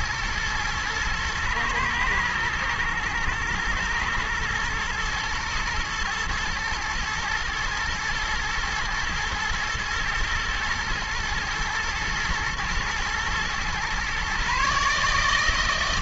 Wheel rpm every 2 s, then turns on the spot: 120, 110, 110, 110, 110, 120, 110, 140.
none